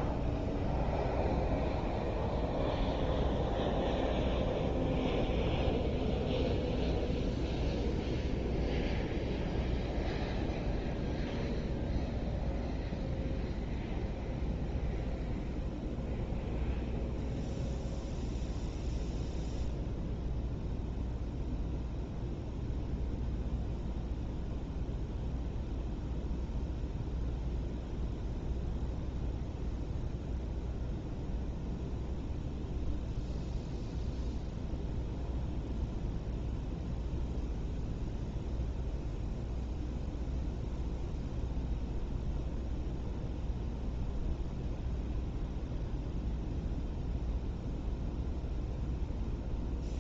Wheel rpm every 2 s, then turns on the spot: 0, 0, 0, 0, 0, 0, 0, 0, 0, 0, 0, 0, 0, 0, 0, 0, 0, 0, 0, 0, 0, 0, 0, 0, 0.
none